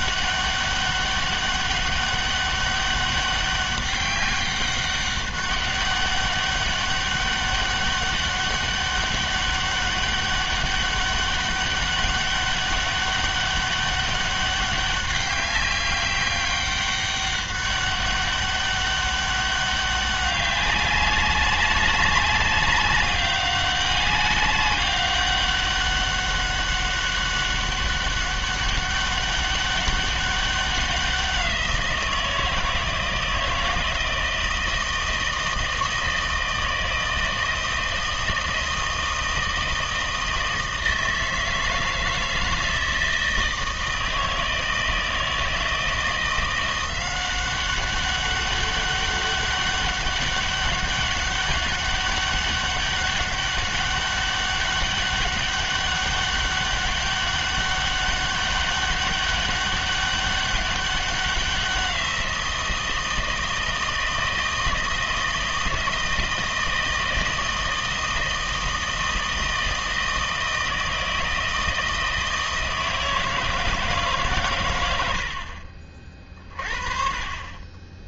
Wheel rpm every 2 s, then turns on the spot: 200, 200, 200, 200, 200, 200, 200, 200, 200, 200, 200, 200, 200, 200, 200, 190, 160, 160, 160, 160, 160, 160, 160, 180, 200, 200, 200, 200, 200, 200, 200, 170, 160, 160, 160, 160, 160, 100, 40.
none